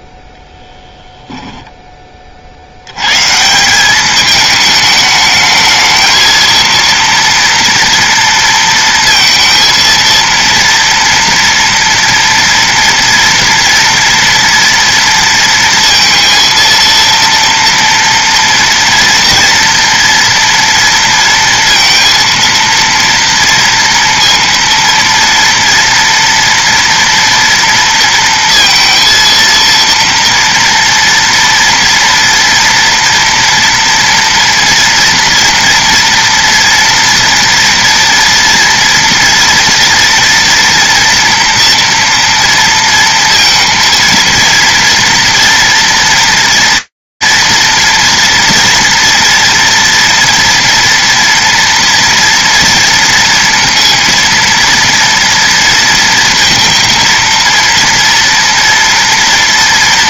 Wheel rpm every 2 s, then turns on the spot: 0, 80, 210, 230, 230, 230, 230, 230, 230, 240, 230, 230, 230, 240, 230, 230, 230, 230, 230, 240, 240, 230, 230, 230, 230, 240, 230, 230, 230, 240.
none